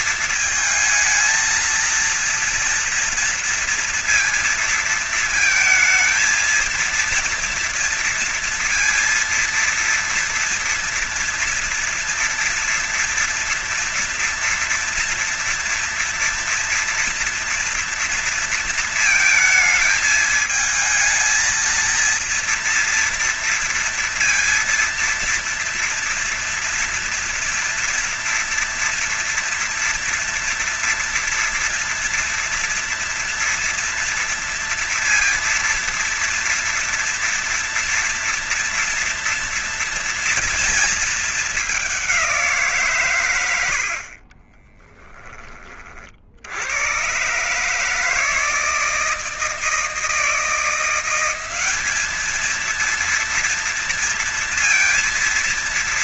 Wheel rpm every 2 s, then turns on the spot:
220, 230, 230, 230, 230, 230, 230, 240, 230, 230, 220, 230, 230, 230, 230, 230, 230, 230, 230, 230, 230, 150, 30, 120, 160, 180, 230, 230.
none